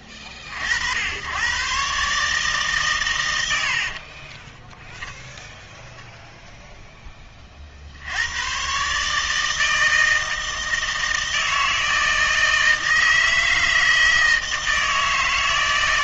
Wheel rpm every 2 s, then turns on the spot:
60, 140, 10, 0, 120, 160, 160, 160.
4-6